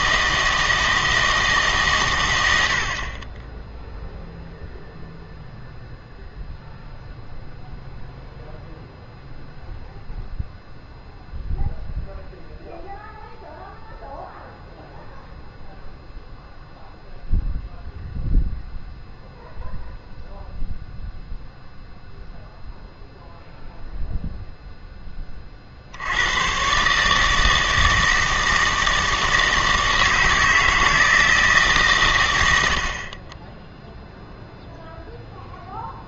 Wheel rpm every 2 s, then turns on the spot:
160, 90, 0, 0, 0, 0, 0, 0, 0, 0, 0, 0, 0, 120, 160, 160, 80, 0.
none